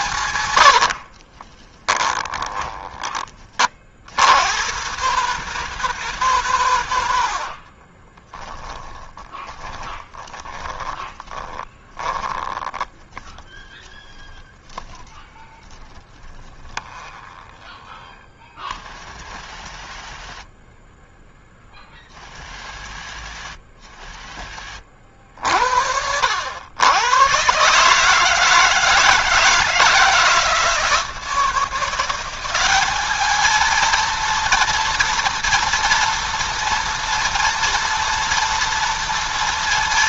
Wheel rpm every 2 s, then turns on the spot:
80, 20, 130, 110, 10, 10, 10, 10, 20, 40, 20, 50, 50, 100, 160, 160, 200, 230, 230, 230.
0-2 6-14 16-18